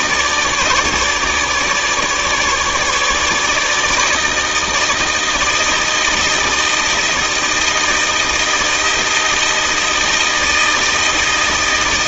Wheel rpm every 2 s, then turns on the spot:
150, 150, 160, 160, 160, 160.
none